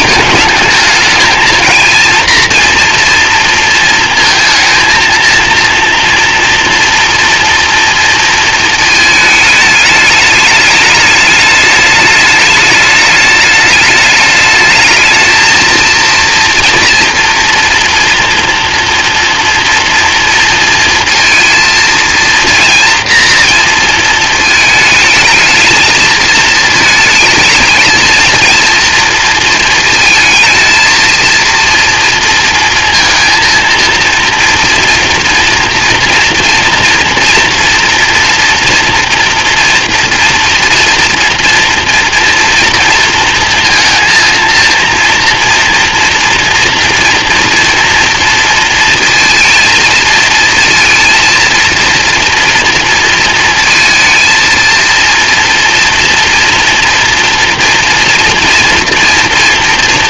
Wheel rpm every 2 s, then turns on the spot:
220, 240, 230, 230, 230, 210, 210, 210, 230, 230, 230, 230, 220, 220, 230, 220, 230, 230, 230, 240, 230, 230, 230, 240, 230, 230, 230, 230, 230, 230.
none